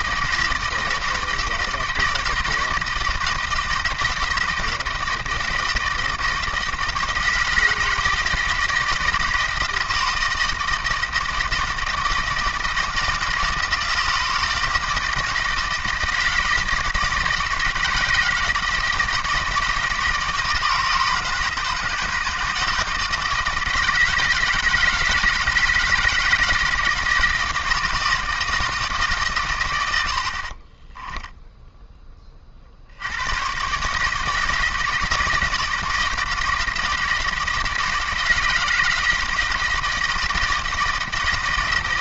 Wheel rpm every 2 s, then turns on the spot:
160, 170, 160, 160, 160, 160, 160, 160, 160, 160, 160, 160, 160, 160, 160, 30, 60, 160, 160, 160, 160.
30-32